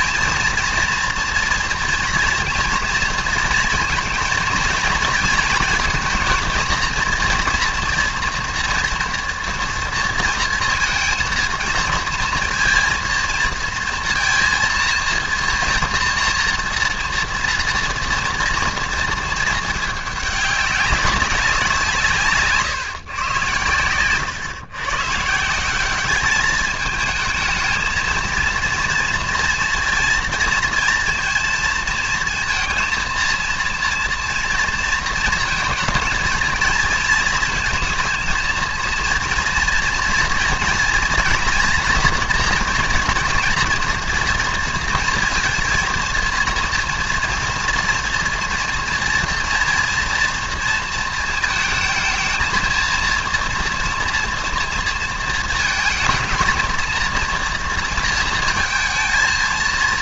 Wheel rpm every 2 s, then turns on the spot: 230, 240, 230, 230, 230, 230, 230, 230, 230, 230, 200, 150, 130, 210, 230, 230, 230, 230, 230, 230, 240, 240, 230, 230, 230, 230, 230, 230, 220, 220.
none